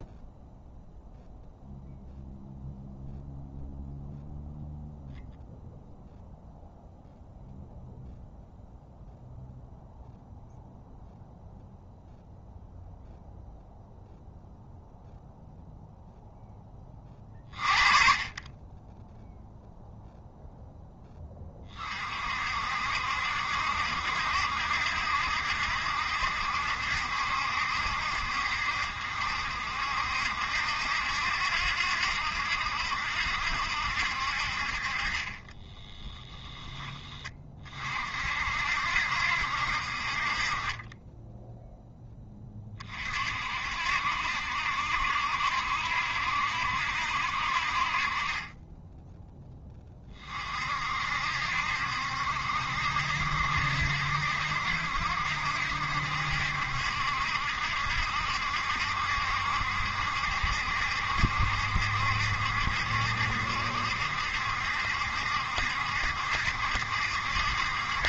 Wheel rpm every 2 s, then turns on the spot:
0, 0, 0, 0, 0, 0, 0, 0, 20, 20, 10, 60, 70, 70, 60, 70, 70, 50, 10, 60, 30, 30, 70, 70, 20, 50, 70, 70, 70, 70, 70, 70, 70, 70.
36-38